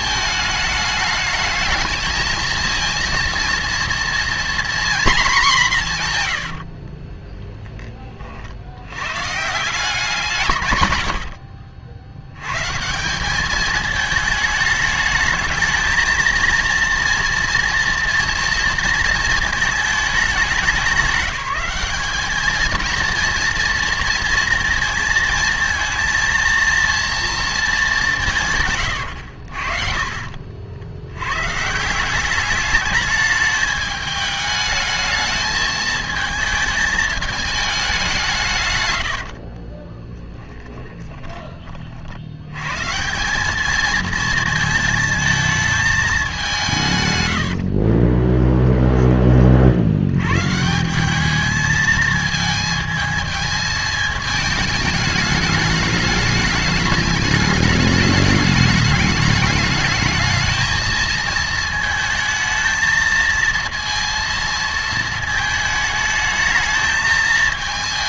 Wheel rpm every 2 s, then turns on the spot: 210, 220, 240, 70, 70, 130, 140, 210, 230, 230, 200, 220, 230, 230, 130, 70, 200, 210, 220, 150, 10, 120, 230, 180, 10, 150, 220, 210, 210, 210, 220, 220, 230, 220.
6-8 28-30 40-42 48-50